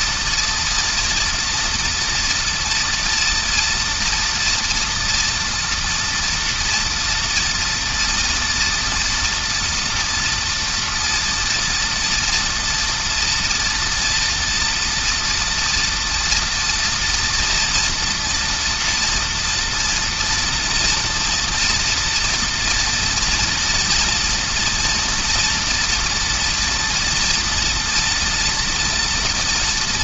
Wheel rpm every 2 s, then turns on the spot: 230, 230, 230, 230, 230, 230, 230, 230, 230, 230, 230, 230, 240, 230, 230.
none